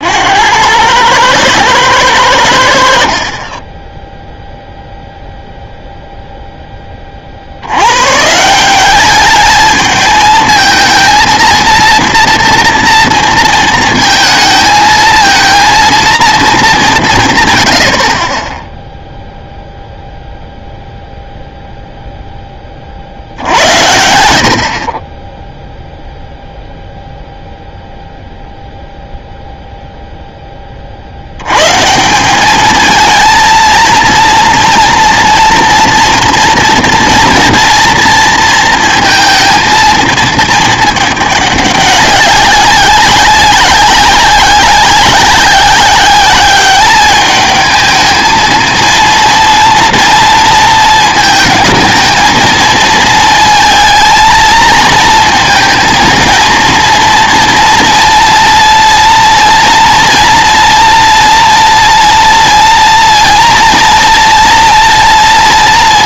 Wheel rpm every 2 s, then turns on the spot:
90, 70, 0, 10, 180, 230, 230, 220, 210, 10, 0, 30, 50, 0, 0, 30, 220, 230, 230, 230, 220, 190, 190, 200, 230, 230, 220, 220, 230, 230, 230, 230, 230.
none